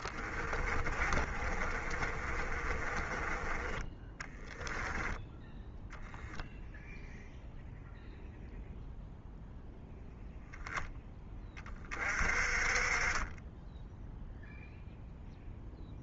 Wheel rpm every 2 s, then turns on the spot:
20, 30, 10, 0, 0, 0, 30, 0.
0-6